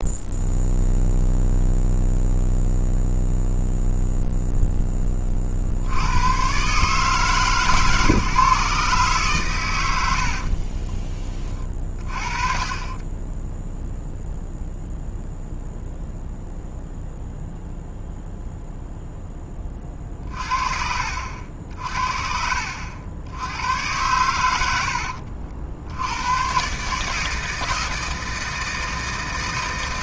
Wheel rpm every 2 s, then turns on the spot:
0, 0, 0, 120, 140, 40, 30, 0, 0, 0, 40, 70, 90, 130, 160.
10-14